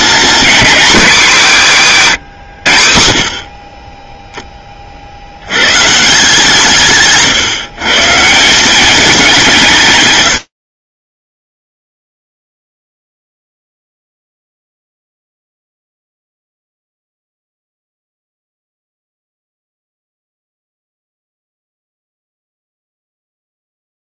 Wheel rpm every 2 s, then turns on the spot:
240, 70, 50, 140, 200, 20, 0, 0, 0, 0, 0, 0.
none